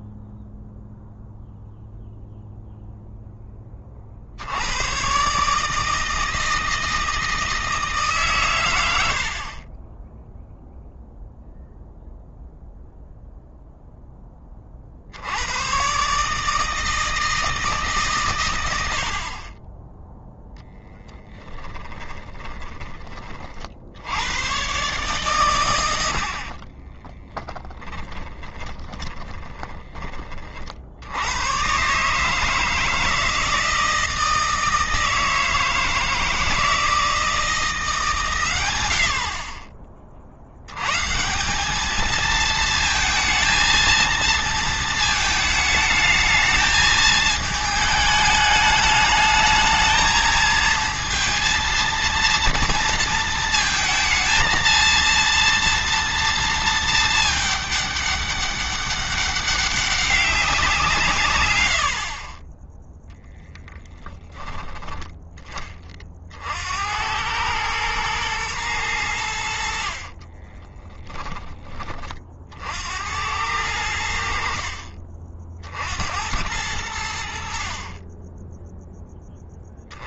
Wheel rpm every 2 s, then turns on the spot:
0, 0, 100, 160, 90, 0, 0, 50, 160, 90, 10, 20, 120, 20, 20, 70, 160, 160, 160, 90, 110, 220, 220, 220, 210, 230, 230, 230, 220, 200, 160, 10, 20, 80, 110, 20, 70, 50, 90, 10.
20-22 26-30 70-72